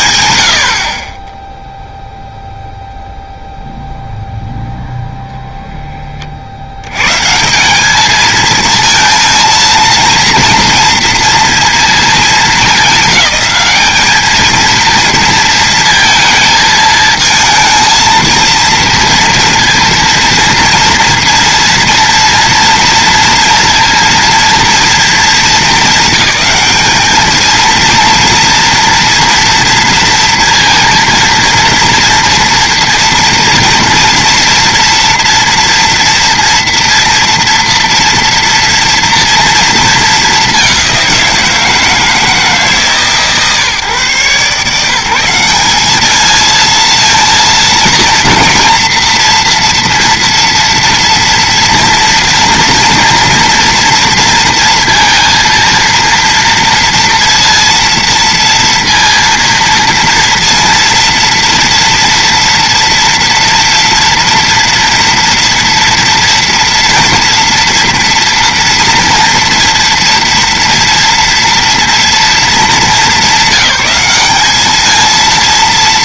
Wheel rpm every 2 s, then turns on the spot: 50, 0, 0, 80, 220, 230, 200, 230, 220, 230, 230, 230, 230, 220, 230, 230, 240, 230, 230, 230, 200, 150, 160, 220, 230, 230, 230, 230, 230, 230, 230, 230, 230, 230, 230, 230, 220, 220.
none